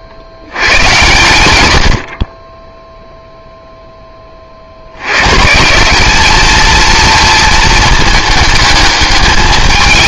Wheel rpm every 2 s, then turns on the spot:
100, 10, 70, 230, 220.
none